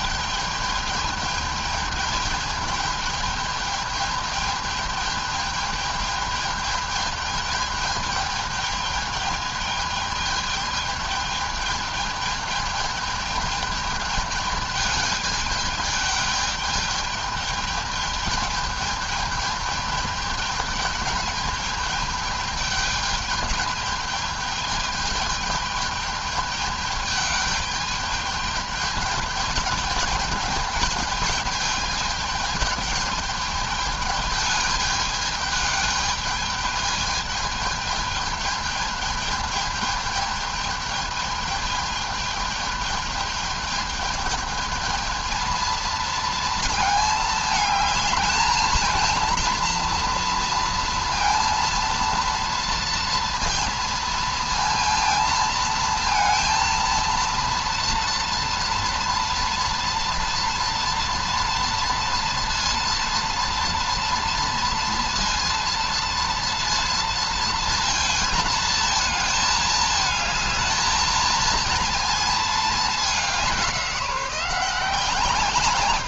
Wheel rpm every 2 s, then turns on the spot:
210, 210, 210, 210, 210, 210, 210, 210, 210, 210, 210, 210, 210, 210, 210, 210, 210, 210, 210, 210, 210, 210, 220, 220, 220, 230, 230, 230, 230, 230, 240, 230, 230, 230, 220, 220, 220, 170.
none